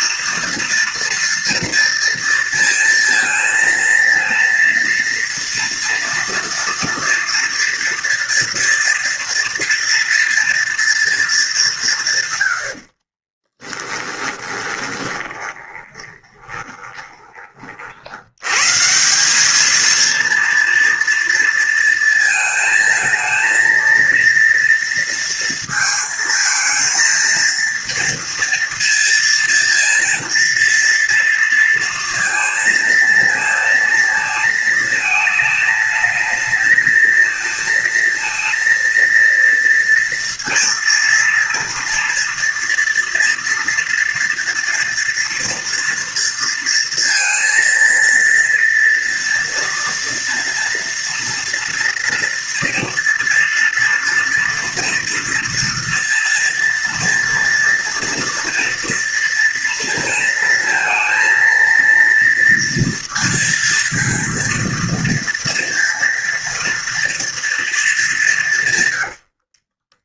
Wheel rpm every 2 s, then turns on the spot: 230, 230, 230, 230, 230, 230, 50, 20, 20, 170, 230, 230, 230, 230, 230, 230, 230, 220, 220, 230, 230, 230, 230, 230, 230, 230, 230, 230, 230, 230, 230, 230, 230, 230, 120.
12-18 68-70